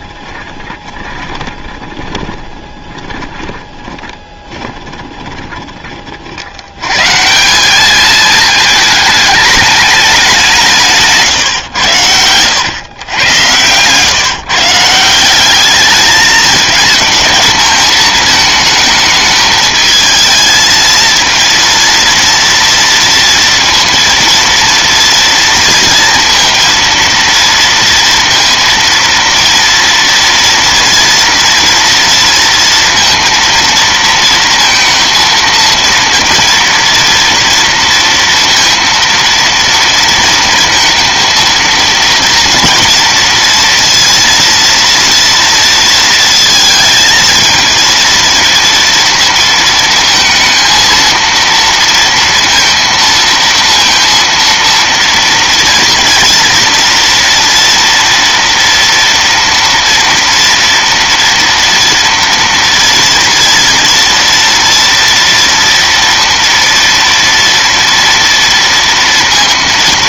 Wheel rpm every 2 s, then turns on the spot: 20, 20, 20, 80, 210, 190, 110, 150, 220, 220, 220, 230, 230, 230, 230, 230, 230, 230, 230, 230, 230, 240, 230, 230, 230, 230, 230, 230, 230, 230, 230, 230, 230, 230, 230.
0-6